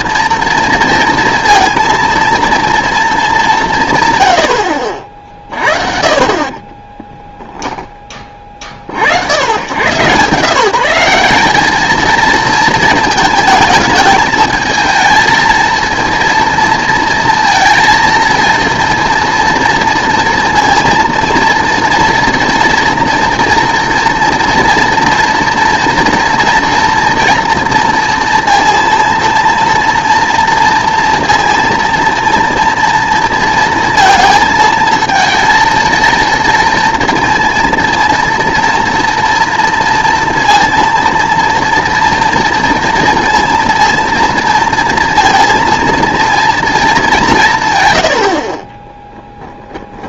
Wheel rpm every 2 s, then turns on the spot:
230, 230, 60, 30, 40, 170, 220, 220, 230, 230, 230, 230, 240, 230, 230, 230, 230, 220, 230, 230, 230, 230, 230, 220, 30.
6-8 48-50